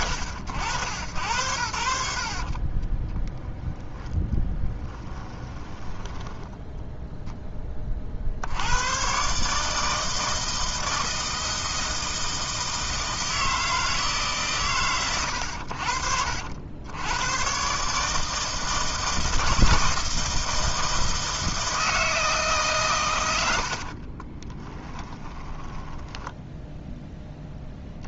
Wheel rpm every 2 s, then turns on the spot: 80, 20, 10, 0, 100, 160, 160, 130, 100, 160, 160, 130, 20, 10.
2-6 24-26